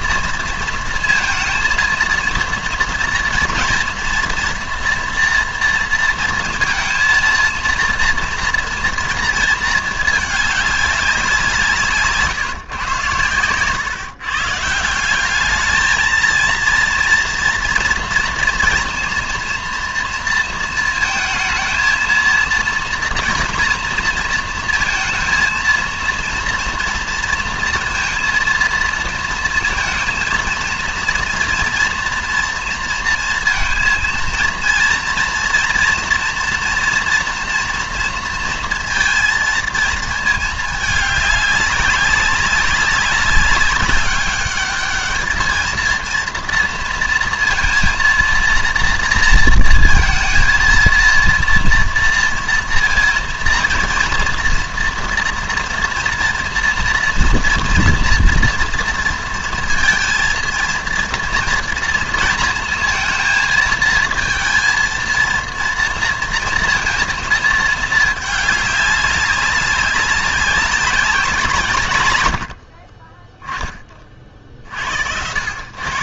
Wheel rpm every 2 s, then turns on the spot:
230, 230, 230, 220, 230, 200, 140, 150, 230, 230, 230, 230, 230, 230, 230, 230, 230, 230, 230, 230, 210, 190, 200, 230, 230, 230, 230, 230, 230, 230, 230, 230, 230, 230, 200, 190, 80, 50.
none